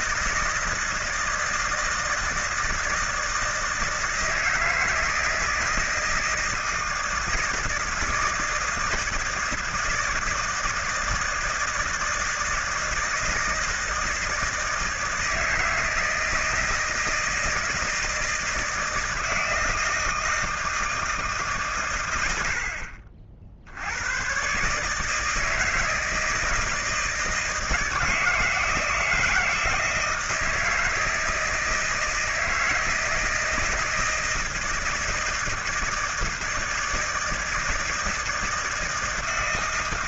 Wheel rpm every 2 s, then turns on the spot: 160, 160, 160, 160, 160, 160, 160, 160, 160, 160, 160, 70, 140, 160, 160, 160, 160, 160, 160, 160.
none